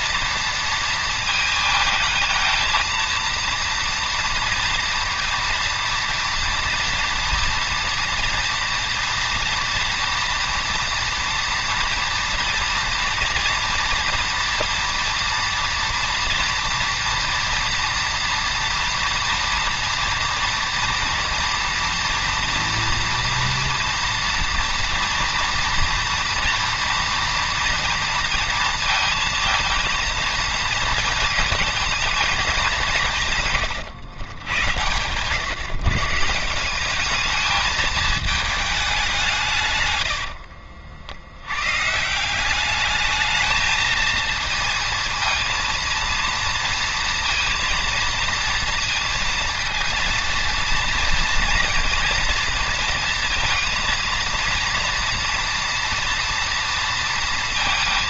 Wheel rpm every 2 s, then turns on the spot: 230, 230, 230, 230, 230, 240, 230, 240, 230, 240, 240, 230, 230, 230, 230, 230, 210, 100, 180, 210, 60, 200, 230, 230, 230, 230, 230, 230, 230.
40-42